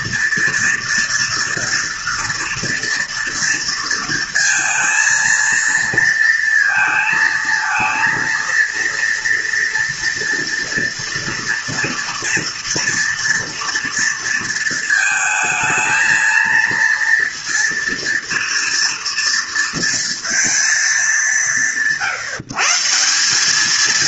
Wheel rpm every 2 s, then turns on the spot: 230, 230, 230, 220, 230, 230, 230, 230, 230, 230, 200, 160.
none